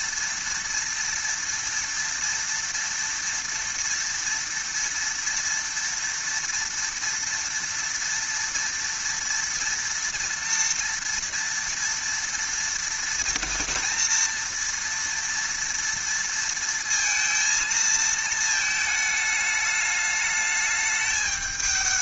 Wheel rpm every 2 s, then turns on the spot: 230, 230, 240, 230, 230, 230, 230, 240, 230, 220, 210.
none